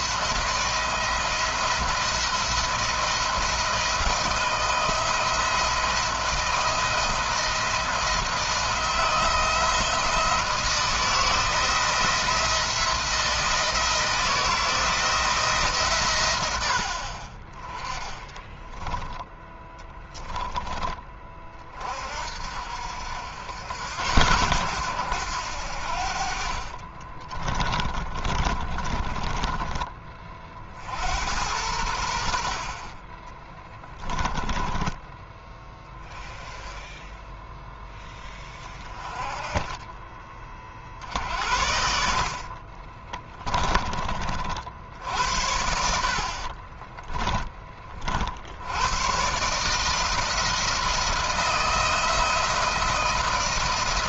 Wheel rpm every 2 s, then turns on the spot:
170, 170, 170, 170, 160, 160, 170, 170, 60, 10, 20, 60, 90, 40, 20, 60, 40, 10, 10, 20, 40, 40, 60, 10, 110, 160, 160.
18-20 26-30 42-44